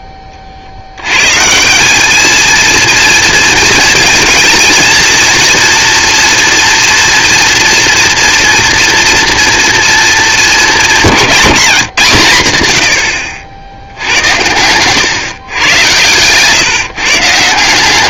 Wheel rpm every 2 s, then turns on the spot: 90, 230, 230, 230, 230, 180, 80, 120, 140.
14-16